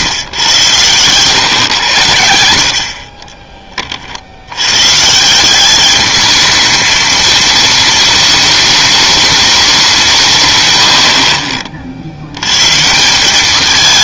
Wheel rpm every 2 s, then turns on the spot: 100, 60, 120, 220, 220, 100, 150.
none